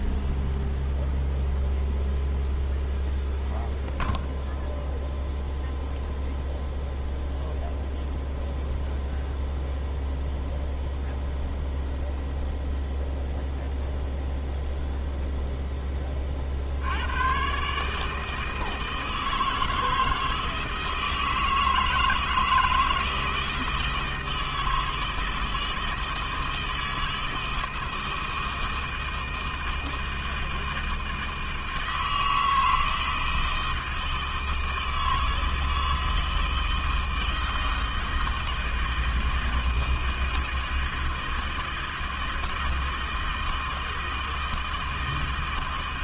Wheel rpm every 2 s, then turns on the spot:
0, 0, 0, 0, 0, 0, 0, 0, 80, 160, 160, 160, 160, 160, 160, 160, 160, 160, 160, 160, 160, 160, 160.
none